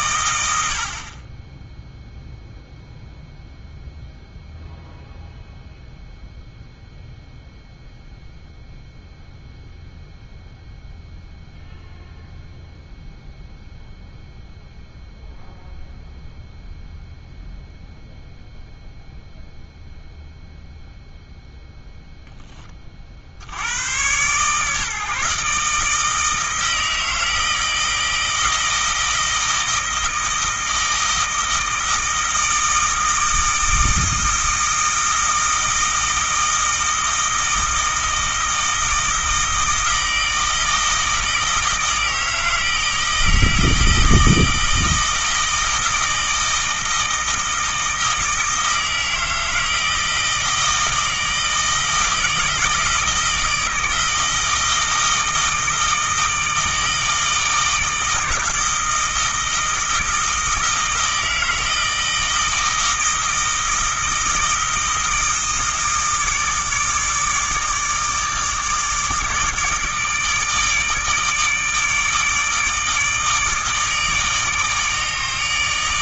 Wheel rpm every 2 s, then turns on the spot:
80, 0, 0, 0, 0, 0, 0, 0, 0, 0, 0, 20, 140, 160, 160, 160, 160, 160, 160, 160, 160, 160, 160, 160, 160, 160, 160, 160, 160, 160, 160, 160, 160, 150, 150, 150, 150, 150.
none